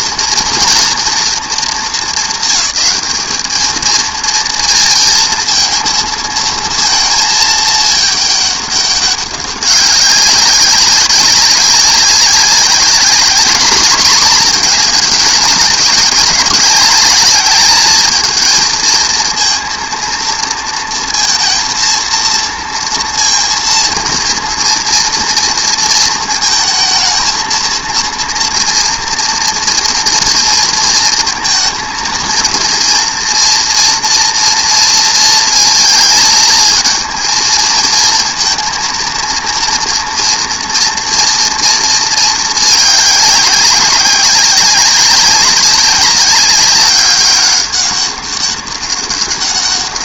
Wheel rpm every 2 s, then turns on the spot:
230, 220, 230, 230, 210, 200, 190, 220, 200, 220, 230, 230, 230, 220, 230, 230, 230, 230, 220, 230, 230, 210, 190, 200, 200.
none